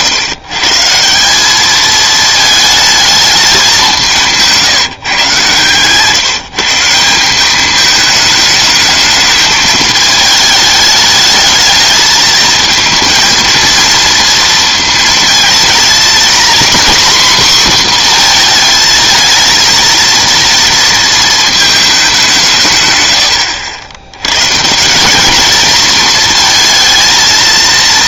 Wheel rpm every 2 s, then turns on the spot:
140, 220, 160, 160, 210, 210, 220, 230, 260, 230, 230, 160, 140, 230.
none